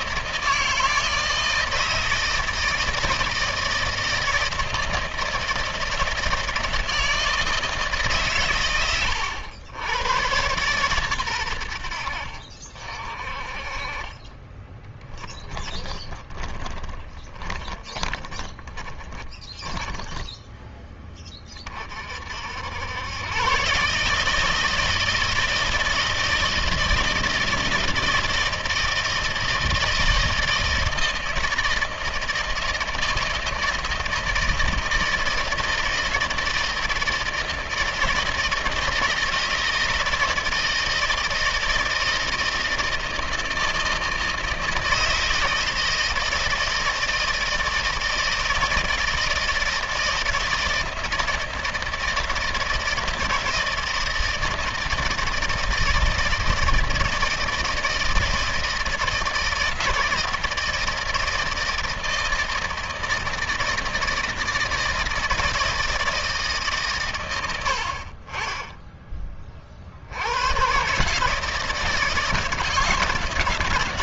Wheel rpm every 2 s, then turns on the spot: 160, 160, 160, 160, 130, 110, 60, 20, 10, 20, 10, 70, 160, 160, 160, 160, 160, 160, 170, 160, 160, 160, 160, 160, 160, 160, 160, 160, 160, 160, 160, 160, 160, 160, 30, 90, 160.
14-22